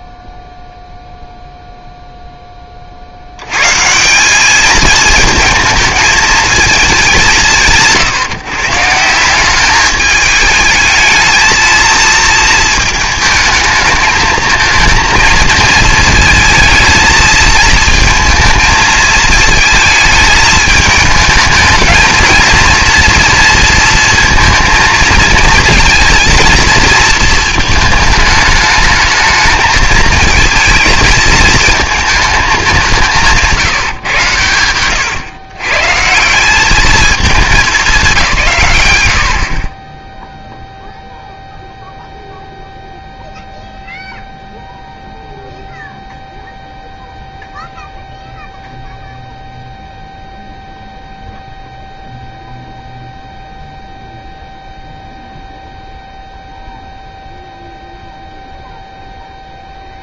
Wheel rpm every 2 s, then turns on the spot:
0, 30, 210, 210, 150, 220, 220, 220, 220, 220, 220, 230, 230, 230, 220, 220, 190, 110, 200, 130, 0, 0, 0, 0, 0, 0, 0, 0, 0, 0.
34-36